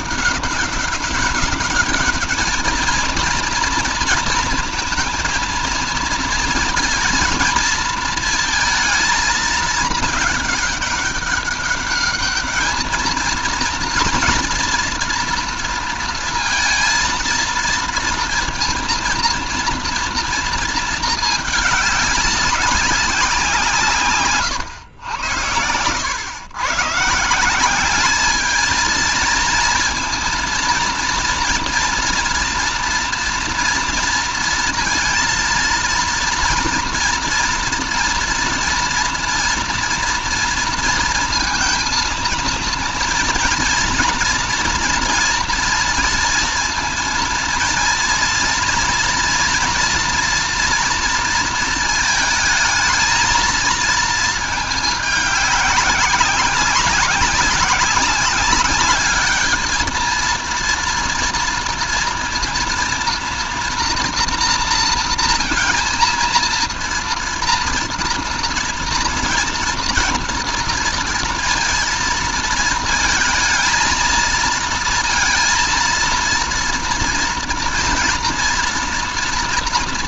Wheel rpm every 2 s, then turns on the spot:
200, 220, 230, 230, 220, 200, 220, 230, 230, 230, 220, 180, 100, 160, 230, 230, 230, 230, 230, 230, 230, 230, 230, 230, 230, 230, 220, 210, 200, 210, 230, 230, 230, 230, 230, 230, 230, 230, 230, 230.
none